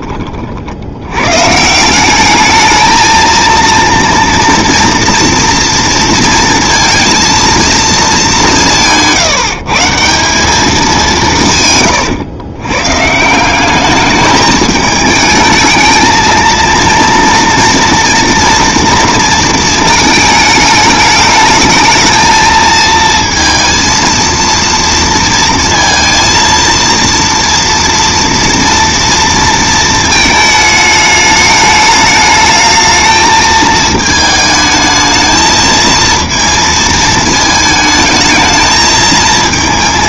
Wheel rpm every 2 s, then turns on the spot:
70, 220, 230, 230, 170, 200, 130, 210, 230, 230, 210, 220, 230, 230, 230, 220, 220, 220, 220, 220.
none